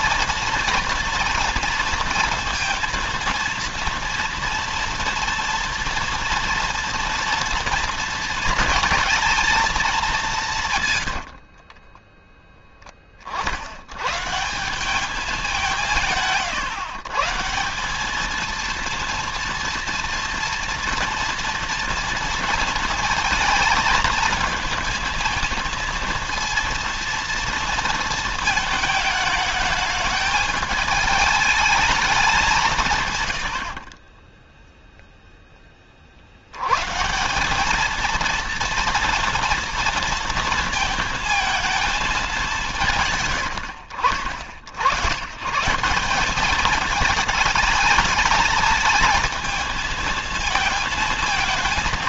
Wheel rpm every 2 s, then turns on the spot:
230, 230, 230, 230, 230, 90, 20, 190, 140, 230, 230, 230, 230, 230, 220, 220, 150, 0, 140, 230, 220, 150, 90, 220, 230, 220.
10-12